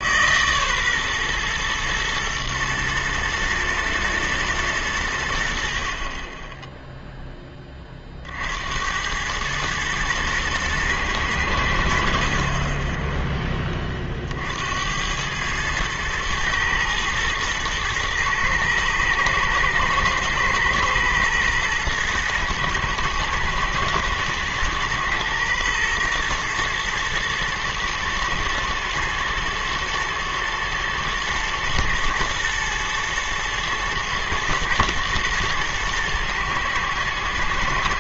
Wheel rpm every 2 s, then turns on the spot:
140, 110, 110, 10, 70, 110, 20, 60, 110, 110, 110, 110, 120, 120, 110, 110, 120, 110, 110.
12-14